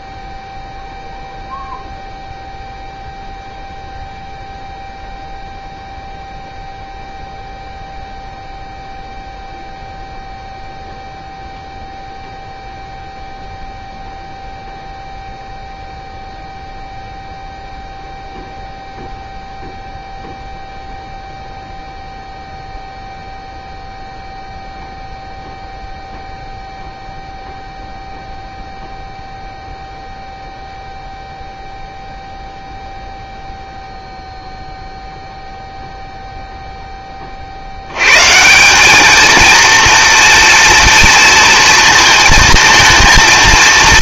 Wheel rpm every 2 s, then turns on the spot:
0, 0, 0, 0, 0, 0, 0, 0, 0, 0, 0, 0, 0, 0, 0, 0, 0, 0, 0, 170, 230, 230.
none